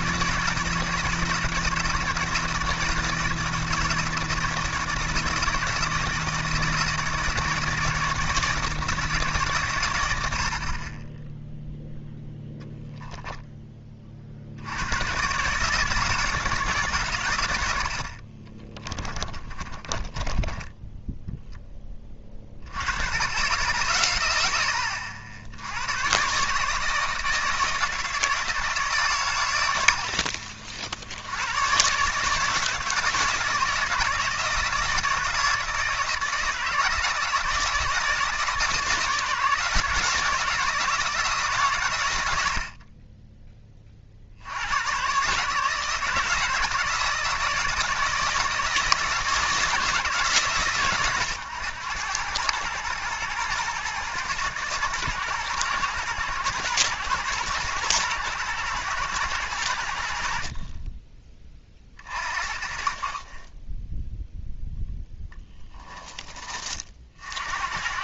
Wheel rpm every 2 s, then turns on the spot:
160, 160, 160, 160, 160, 40, 10, 90, 150, 30, 20, 20, 20, 150, 160, 80, 160, 160, 160, 160, 160, 60, 100, 160, 160, 120, 110, 120, 110, 110, 40, 40, 0, 40.
18-22